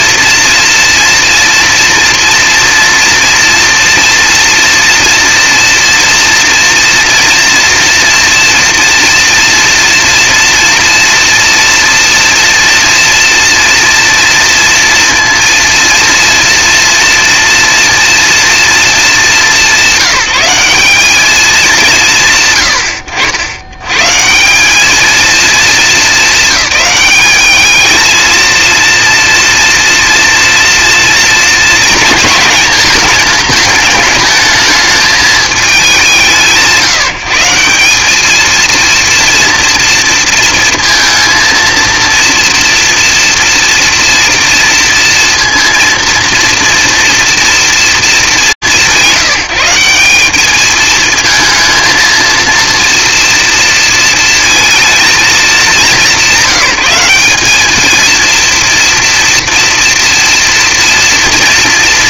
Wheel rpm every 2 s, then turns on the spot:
240, 240, 230, 240, 230, 230, 230, 230, 230, 220, 210, 110, 210, 210, 230, 230, 220, 210, 160, 230, 230, 230, 230, 230, 180, 220, 230, 220, 190, 230, 240.
none